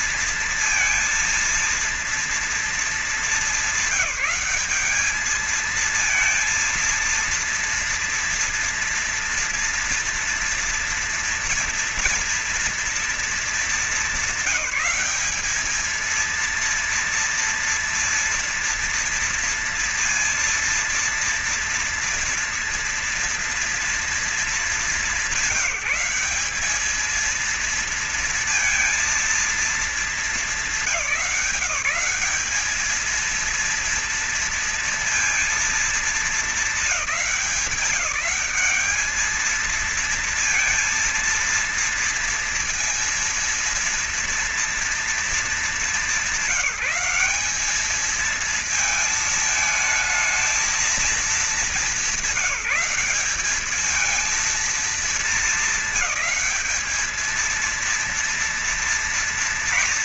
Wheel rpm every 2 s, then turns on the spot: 230, 230, 210, 230, 230, 230, 230, 190, 230, 230, 230, 230, 210, 200, 230, 210, 210, 230, 220, 210, 230, 230, 230, 190, 220, 220, 210, 220, 200, 230.
none